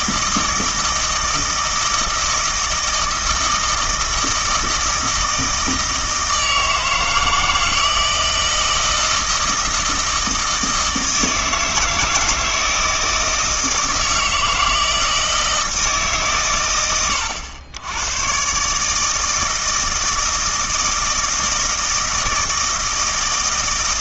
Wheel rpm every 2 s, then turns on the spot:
160, 160, 160, 160, 160, 160, 160, 160, 110, 140, 160, 160.
none